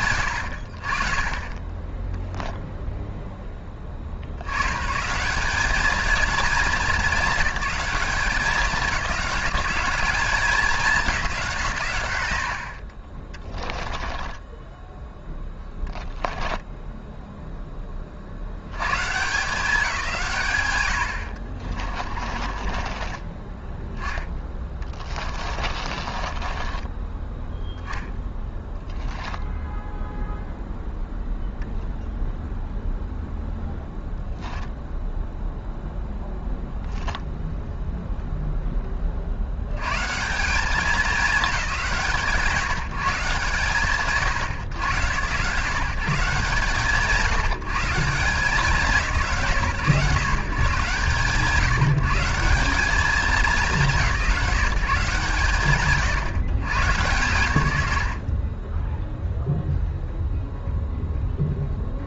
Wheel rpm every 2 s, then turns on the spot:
60, 0, 140, 190, 190, 200, 40, 0, 0, 120, 60, 30, 20, 20, 10, 0, 0, 0, 0, 20, 200, 150, 110, 140, 150, 140, 210, 140, 130, 10, 0.
22-30